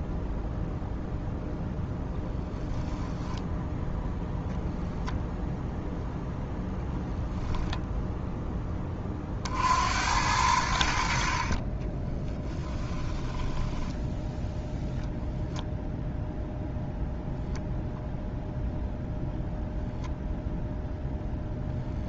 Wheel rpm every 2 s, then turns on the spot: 0, 0, 0, 0, 20, 80, 10, 0, 0, 0, 0.
12-14